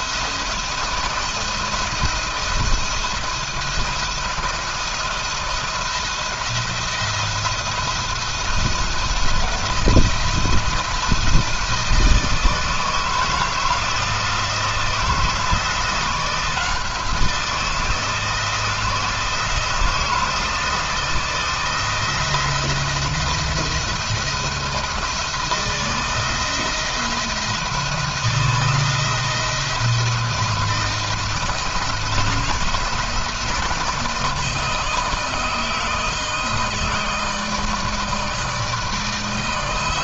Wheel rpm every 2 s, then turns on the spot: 170, 170, 170, 170, 170, 170, 160, 160, 170, 160, 160, 170, 170, 160, 160, 160, 170, 160, 160, 160.
none